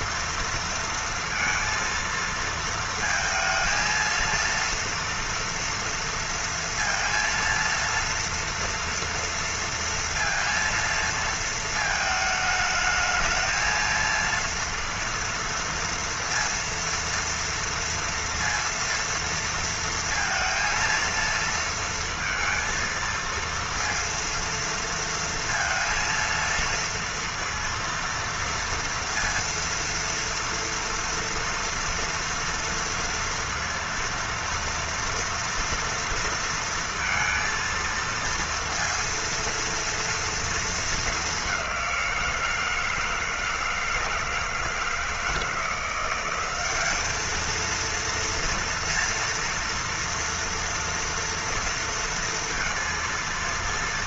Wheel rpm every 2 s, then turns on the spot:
230, 230, 230, 230, 230, 230, 220, 230, 230, 230, 230, 230, 230, 230, 230, 230, 230, 230, 230, 230, 230, 170, 160, 190, 230, 240, 230.
none